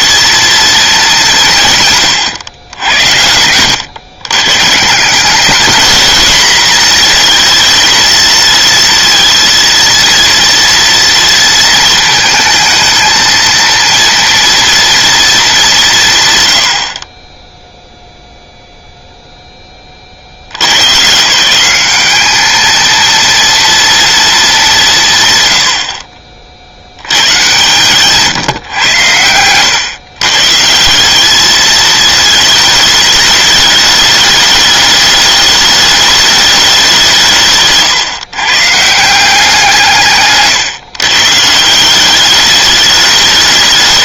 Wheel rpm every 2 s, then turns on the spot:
220, 100, 150, 230, 230, 230, 220, 230, 80, 0, 90, 220, 190, 80, 120, 150, 220, 210, 200, 150, 130, 210.
none